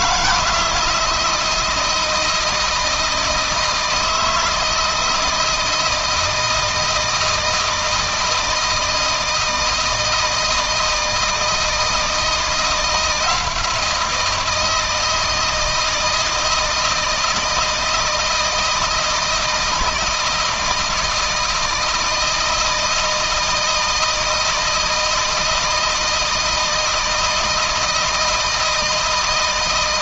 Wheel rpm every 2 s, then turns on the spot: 160, 160, 160, 160, 160, 160, 170, 160, 160, 160, 160, 160, 160, 160, 160.
none